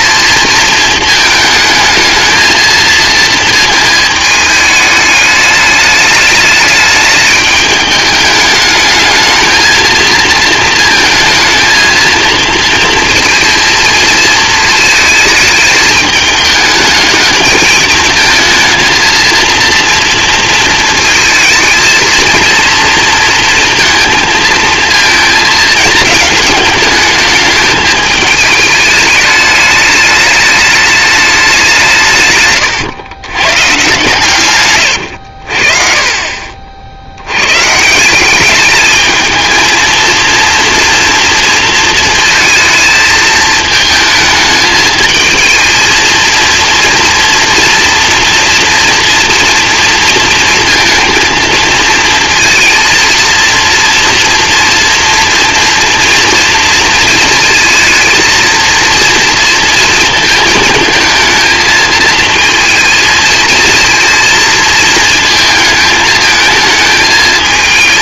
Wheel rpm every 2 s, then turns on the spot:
230, 230, 220, 210, 210, 220, 230, 220, 220, 220, 230, 230, 220, 210, 210, 210, 130, 110, 60, 210, 230, 220, 220, 230, 230, 230, 230, 240, 230, 230, 220, 230, 230, 220.
34-36